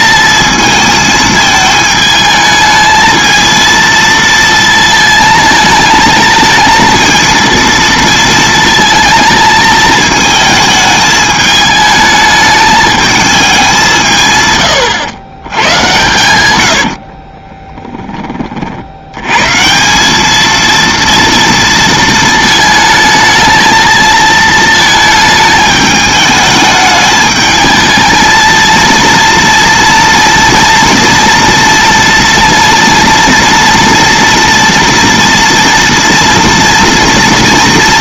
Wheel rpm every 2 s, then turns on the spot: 220, 220, 230, 220, 220, 220, 210, 120, 70, 70, 230, 220, 220, 210, 230, 230, 230, 240, 230.
14-18